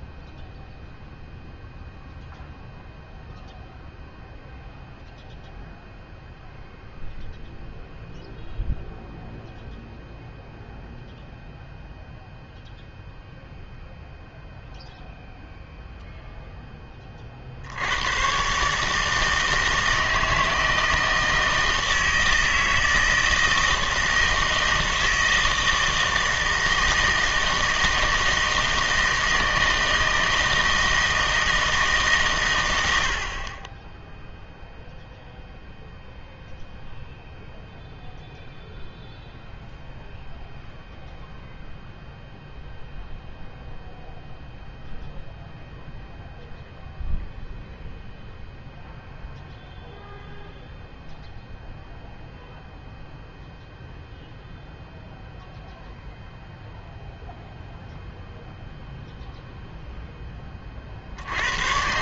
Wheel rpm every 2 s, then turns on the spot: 0, 0, 0, 0, 0, 0, 0, 0, 10, 140, 160, 160, 160, 160, 160, 160, 100, 0, 0, 0, 0, 0, 0, 0, 0, 0, 0, 0, 0, 0, 40.
none